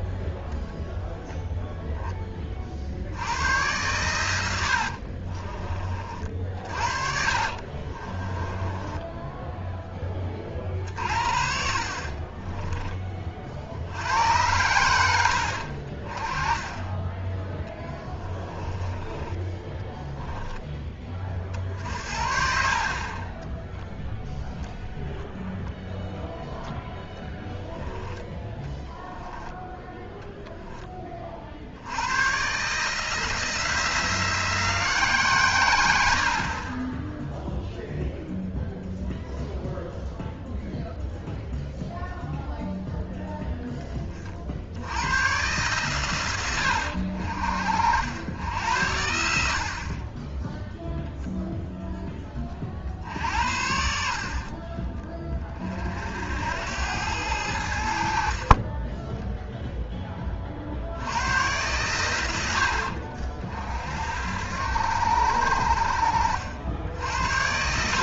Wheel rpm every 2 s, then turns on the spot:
0, 50, 70, 50, 10, 40, 20, 90, 20, 20, 10, 40, 0, 0, 10, 10, 140, 160, 30, 0, 0, 0, 70, 90, 90, 0, 50, 30, 90, 20, 60, 60, 80, 70.
4-10 18-20 28-30 66-68